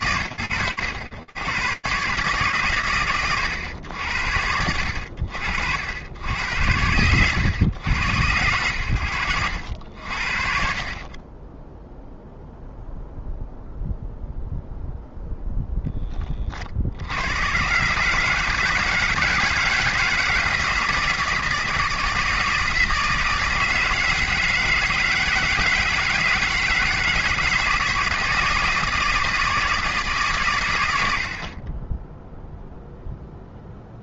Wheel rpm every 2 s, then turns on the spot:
70, 90, 100, 80, 0, 0, 10, 140, 170, 160, 160, 160, 160, 160, 20, 0, 30.
none